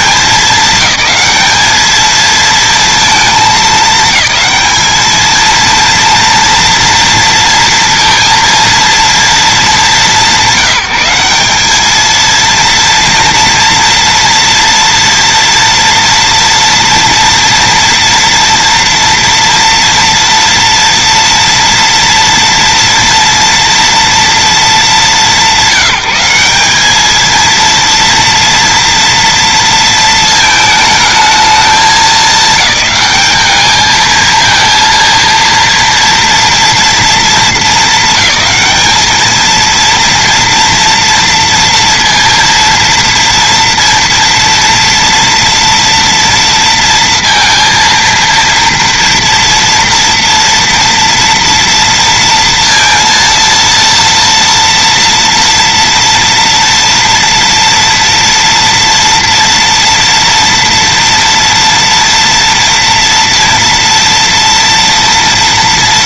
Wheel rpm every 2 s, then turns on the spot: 210, 230, 220, 230, 220, 190, 230, 230, 230, 230, 230, 230, 200, 220, 230, 220, 200, 230, 210, 210, 230, 230, 230, 230, 230, 240, 230, 230, 230, 230, 230, 230, 230.
none